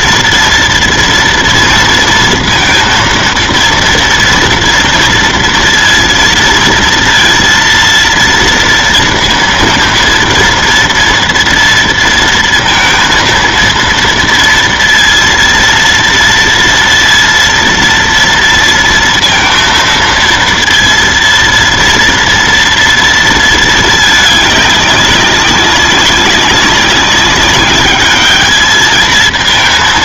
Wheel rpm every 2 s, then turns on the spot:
230, 230, 230, 230, 230, 230, 230, 230, 230, 230, 230, 230, 200, 190, 210.
none